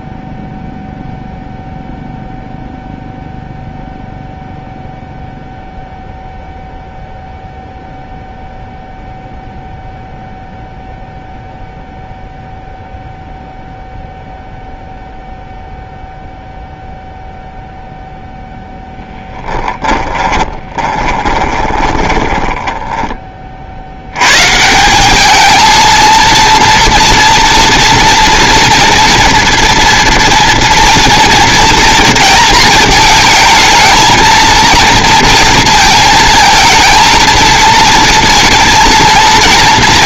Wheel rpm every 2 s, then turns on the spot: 0, 0, 0, 0, 0, 0, 0, 0, 0, 0, 20, 10, 180, 230, 230, 230, 220, 230, 220, 230.
20-24